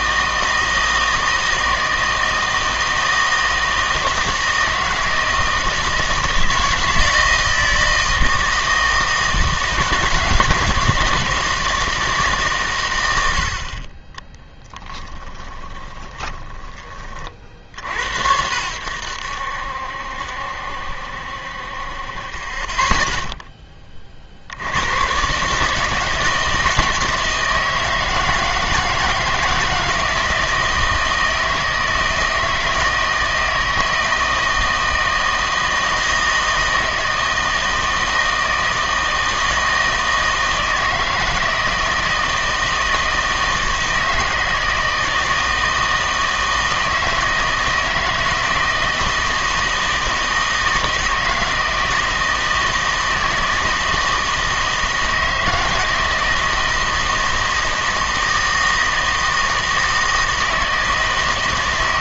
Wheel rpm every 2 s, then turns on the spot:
160, 160, 160, 160, 160, 160, 130, 20, 20, 90, 70, 20, 80, 160, 160, 160, 160, 160, 160, 160, 160, 160, 160, 160, 160, 160, 160, 160, 160, 160, 160.
14-18